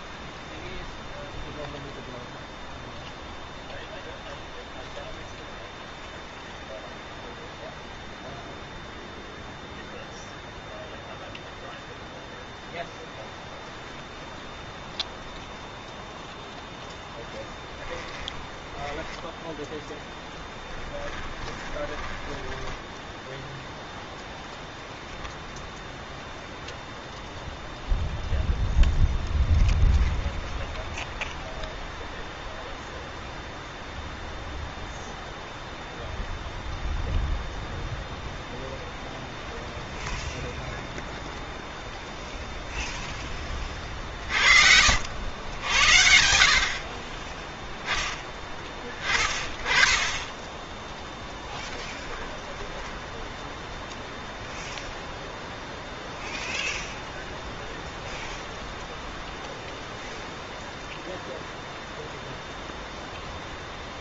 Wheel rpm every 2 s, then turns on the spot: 0, 0, 0, 0, 0, 0, 0, 0, 0, 10, 10, 10, 0, 0, 0, 0, 0, 0, 0, 0, 0, 0, 60, 50, 10, 10, 10, 0, 0, 0, 0, 0.
20-24